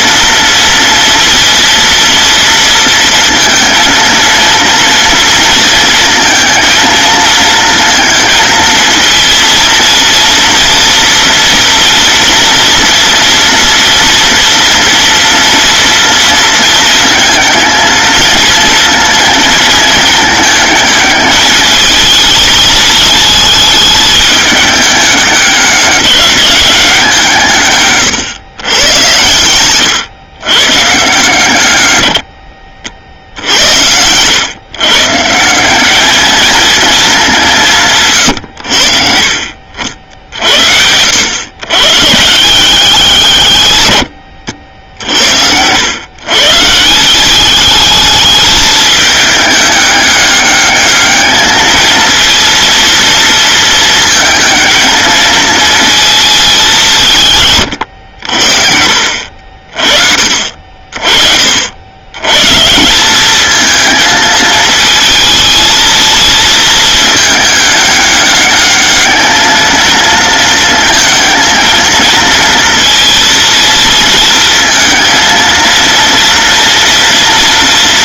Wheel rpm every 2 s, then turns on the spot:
230, 230, 230, 230, 230, 230, 240, 240, 230, 230, 220, 220, 210, 190, 100, 130, 60, 130, 220, 80, 70, 170, 80, 150, 210, 210, 230, 220, 210, 60, 50, 150, 220, 220, 210, 230, 230, 230, 240.
none